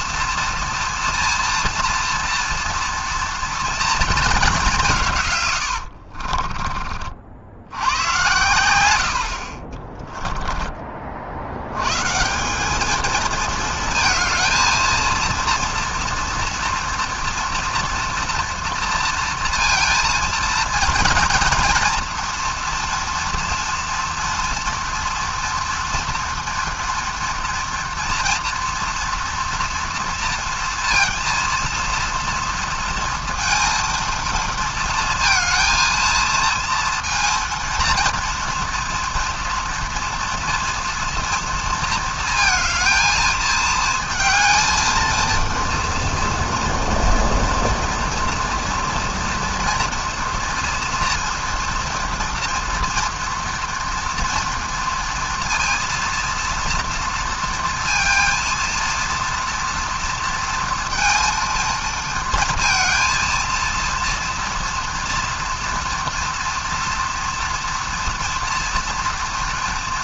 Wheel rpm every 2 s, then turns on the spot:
230, 230, 190, 30, 90, 20, 190, 220, 230, 230, 230, 230, 230, 240, 240, 230, 230, 230, 230, 230, 240, 220, 230, 230, 230, 230, 230, 230, 230, 230, 230, 230, 240, 230, 230.
10-12